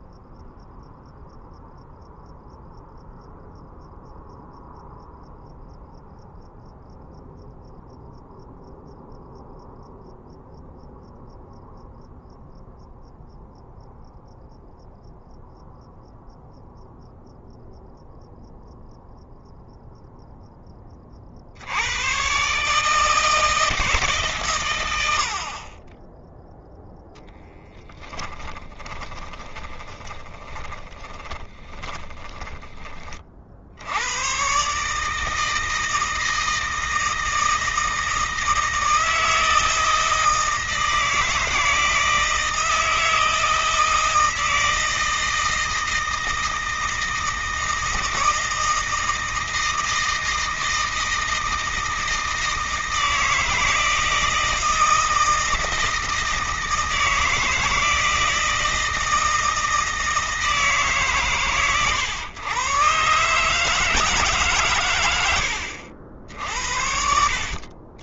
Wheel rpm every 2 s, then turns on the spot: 0, 0, 0, 0, 0, 0, 0, 0, 0, 0, 20, 150, 110, 0, 20, 20, 30, 150, 160, 160, 160, 160, 160, 160, 160, 160, 160, 160, 160, 160, 150, 130, 130, 60.
28-32